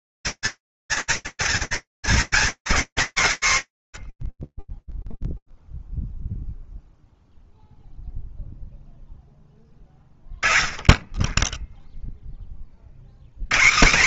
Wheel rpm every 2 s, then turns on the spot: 240, 230, 0, 0, 0, 10, 50.
none